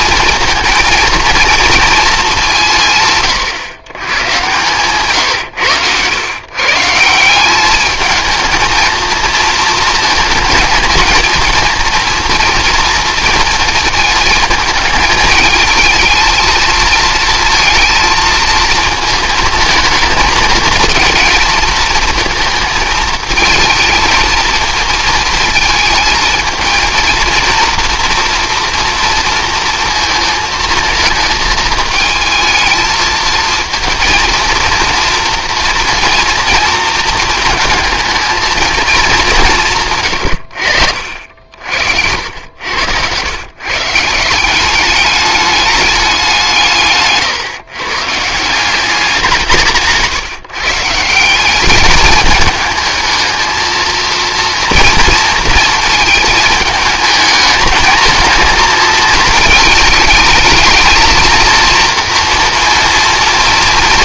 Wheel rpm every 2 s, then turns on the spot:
220, 160, 120, 150, 220, 220, 230, 220, 230, 230, 220, 220, 230, 220, 230, 220, 220, 230, 230, 220, 70, 100, 200, 150, 180, 160, 220, 230, 220, 220, 230, 230.
42-44